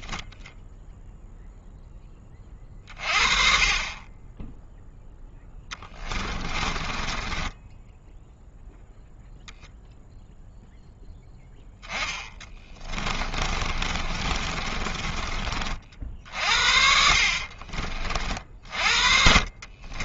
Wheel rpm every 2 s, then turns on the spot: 0, 30, 10, 20, 0, 0, 20, 30, 60, 40.
4-8 12-16